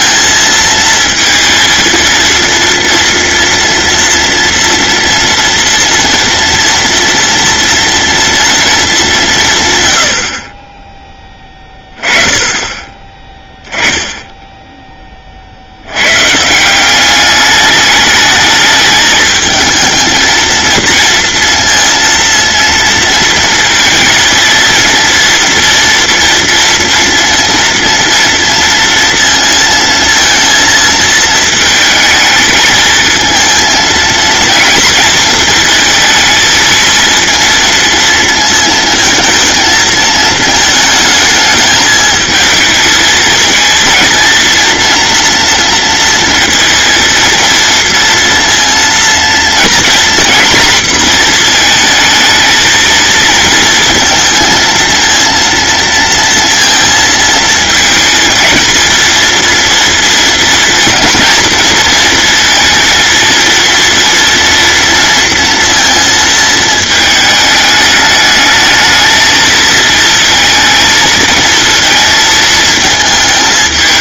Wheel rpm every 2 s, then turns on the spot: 230, 240, 230, 230, 210, 20, 20, 10, 180, 220, 230, 230, 230, 230, 230, 220, 220, 230, 230, 230, 220, 220, 230, 230, 230, 240, 230, 230, 230, 220, 230, 230, 230, 220, 220, 220, 220.
none